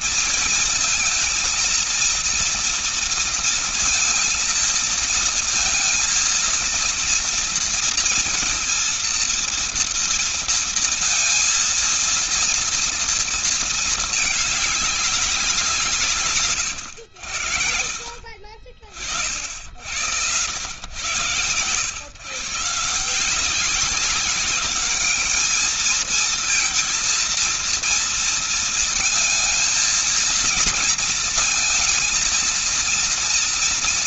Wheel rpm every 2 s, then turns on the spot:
220, 230, 230, 230, 230, 230, 230, 210, 130, 50, 100, 140, 200, 230, 230, 230, 230.
none